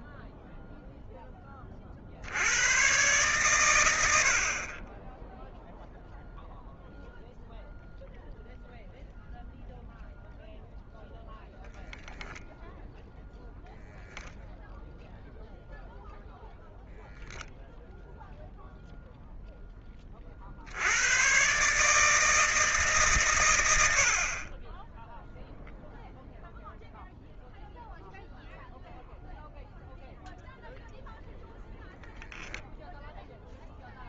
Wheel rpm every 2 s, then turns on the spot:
0, 100, 40, 0, 0, 0, 0, 0, 0, 0, 50, 150, 50, 0, 0, 0, 0.
none